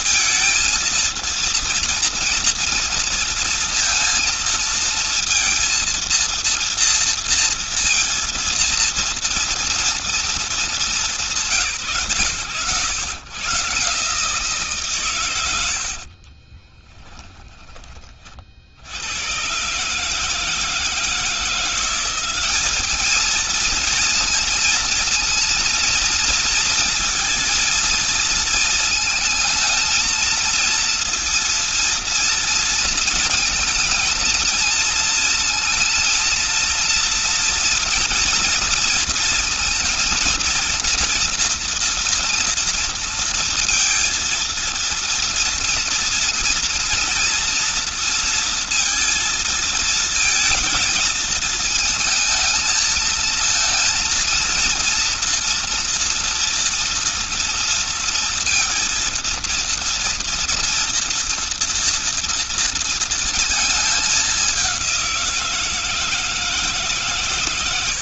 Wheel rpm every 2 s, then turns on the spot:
230, 230, 230, 230, 230, 220, 110, 150, 30, 50, 160, 200, 230, 230, 230, 230, 230, 220, 230, 230, 230, 230, 230, 230, 230, 230, 220, 230, 230, 230, 230, 230, 200, 160.
16-18